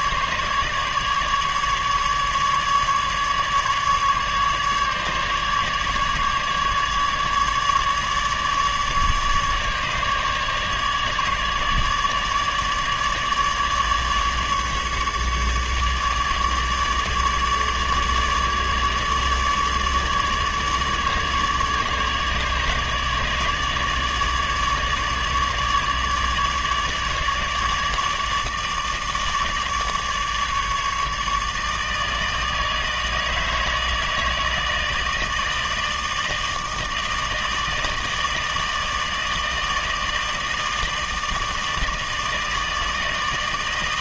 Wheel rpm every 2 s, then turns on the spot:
150, 150, 150, 150, 150, 150, 150, 150, 150, 150, 150, 150, 150, 150, 150, 150, 160, 160, 160, 160, 160, 160.
none